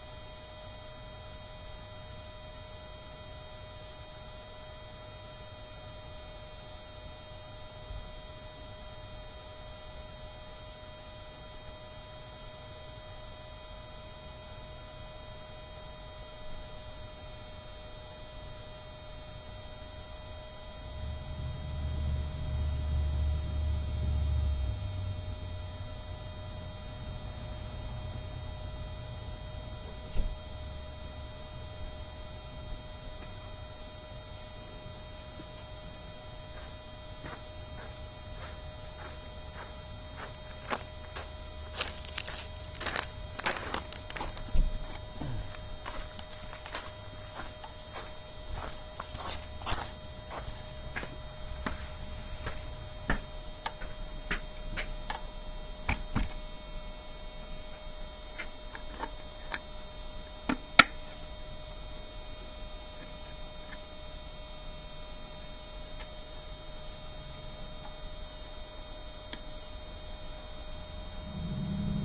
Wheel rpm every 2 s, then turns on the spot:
0, 0, 0, 0, 0, 0, 0, 0, 0, 0, 0, 0, 0, 0, 0, 0, 0, 0, 0, 0, 0, 0, 0, 0, 0, 0, 0, 0, 0, 0, 0, 0, 0, 0, 0, 0.
none